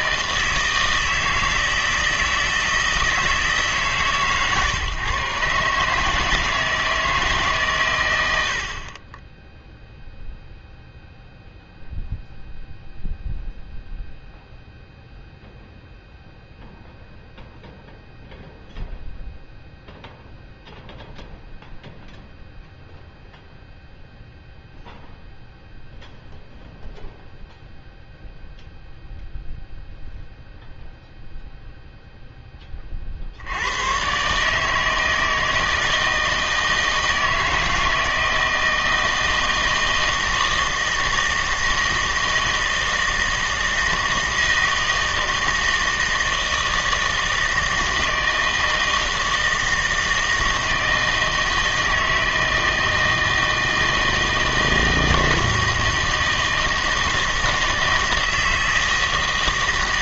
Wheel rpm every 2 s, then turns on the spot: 150, 160, 140, 160, 70, 0, 0, 0, 0, 0, 0, 0, 0, 0, 0, 0, 20, 150, 160, 160, 160, 160, 160, 160, 160, 160, 160, 160, 160, 160.
none